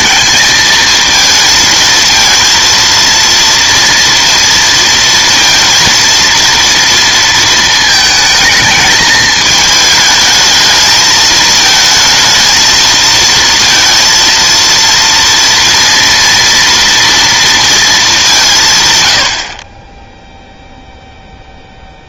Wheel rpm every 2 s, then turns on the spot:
220, 230, 230, 230, 220, 220, 220, 230, 230, 160, 0.
none